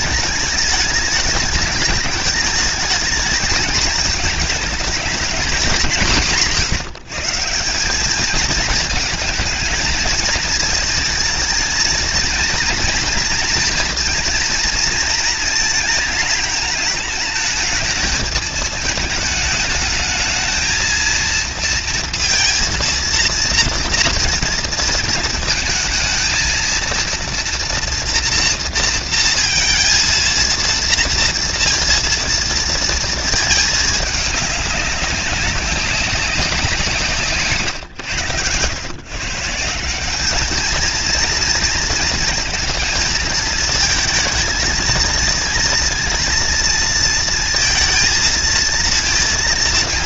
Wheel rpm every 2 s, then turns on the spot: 220, 220, 220, 210, 170, 230, 230, 230, 230, 220, 220, 230, 230, 220, 230, 230, 230, 220, 190, 130, 150, 230, 220, 230, 230.
none